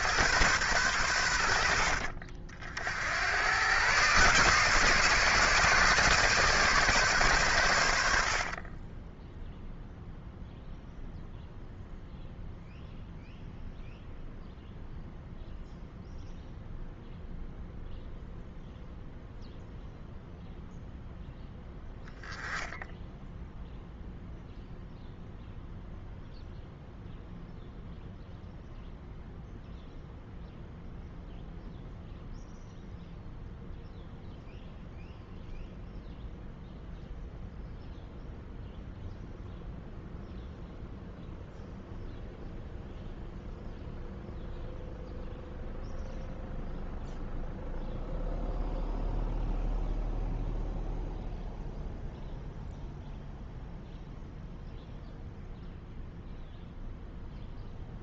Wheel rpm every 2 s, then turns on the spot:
110, 70, 140, 140, 30, 0, 0, 0, 0, 0, 0, 0, 0, 0, 0, 0, 0, 0, 0, 0, 0, 0, 0, 0, 0, 0, 0, 0, 0.
8-10